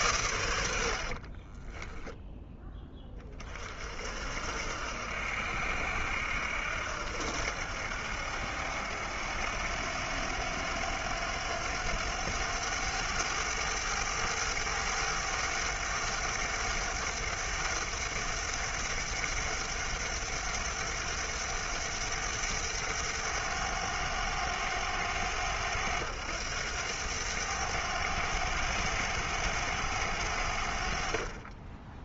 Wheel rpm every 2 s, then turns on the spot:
80, 10, 70, 80, 80, 90, 100, 100, 100, 100, 100, 100, 100, 100, 100, 70.
none